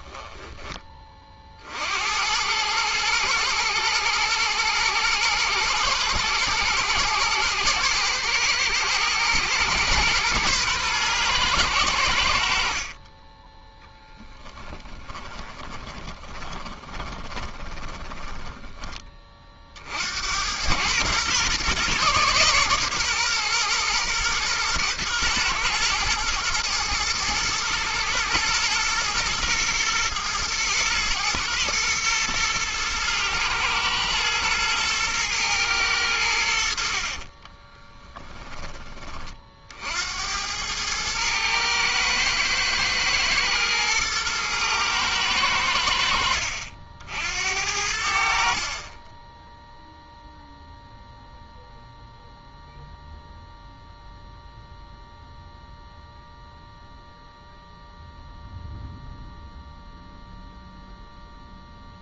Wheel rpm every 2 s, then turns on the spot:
40, 110, 120, 110, 110, 120, 20, 20, 20, 20, 120, 130, 120, 120, 120, 110, 110, 110, 50, 20, 110, 110, 110, 60, 20, 0, 0, 0, 0, 0, 0.
14-18 36-38